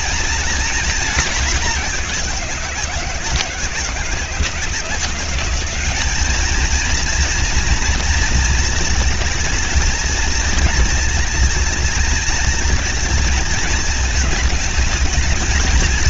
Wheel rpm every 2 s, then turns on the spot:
220, 180, 170, 220, 230, 220, 220, 220.
none